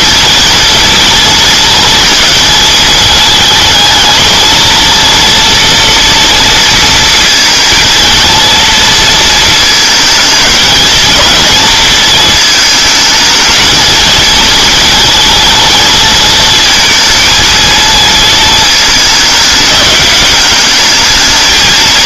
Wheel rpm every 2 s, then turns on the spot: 230, 230, 230, 230, 230, 220, 220, 230, 230, 220, 210.
none